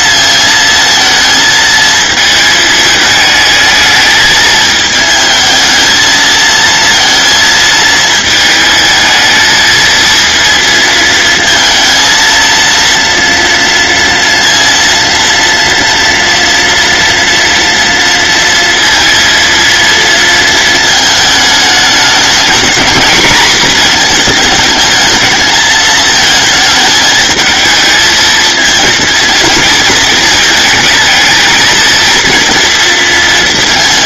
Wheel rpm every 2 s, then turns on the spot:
230, 220, 220, 230, 220, 230, 230, 230, 230, 230, 220, 230, 220, 220, 230, 220, 230.
none